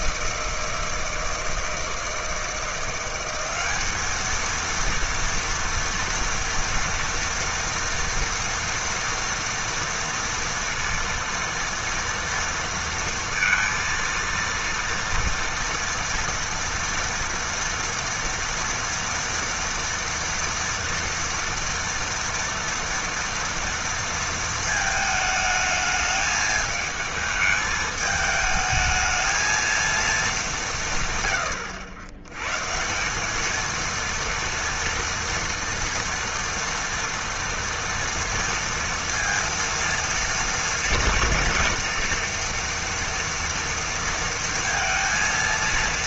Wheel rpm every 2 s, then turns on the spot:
160, 170, 230, 230, 230, 230, 230, 230, 230, 230, 230, 230, 220, 220, 220, 180, 140, 230, 230, 230, 230, 230, 230.
none